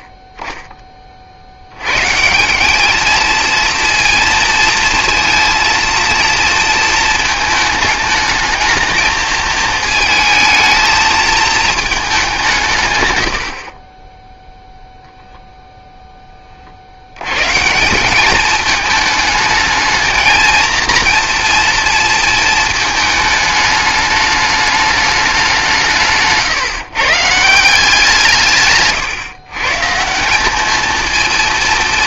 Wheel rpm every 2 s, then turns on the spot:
20, 190, 230, 230, 220, 220, 160, 0, 40, 220, 230, 220, 210, 150, 160, 210.
none